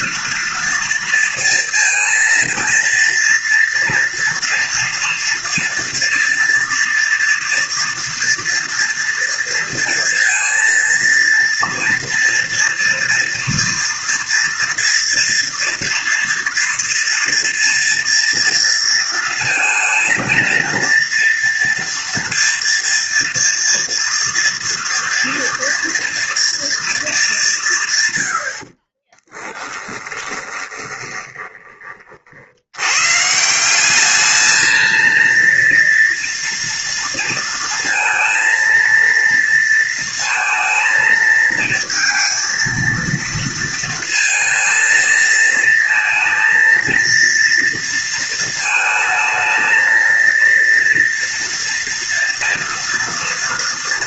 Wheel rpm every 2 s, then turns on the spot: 230, 230, 230, 230, 230, 230, 230, 240, 230, 230, 230, 230, 230, 230, 70, 20, 70, 220, 230, 230, 220, 230, 220, 230, 220, 230, 230.
30-32